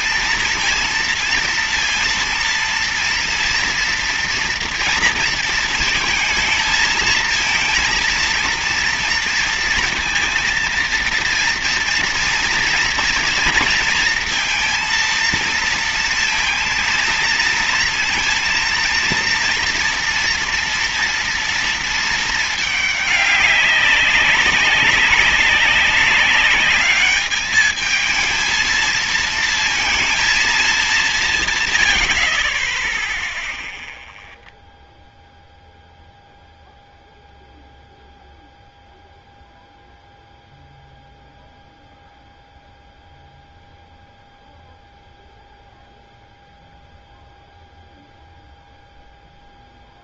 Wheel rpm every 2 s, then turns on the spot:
230, 230, 230, 220, 230, 230, 230, 230, 230, 230, 240, 220, 190, 200, 220, 220, 40, 0, 0, 0, 0, 0, 0, 0, 0.
none